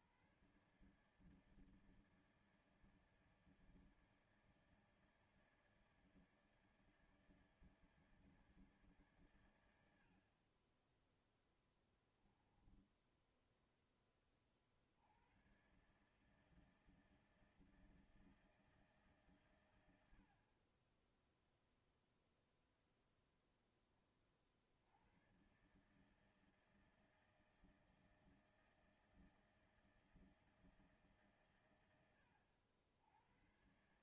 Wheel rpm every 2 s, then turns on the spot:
110, 150, 150, 150, 150, 50, 10, 20, 150, 160, 70, 0, 40, 160, 160, 160, 90.
12-14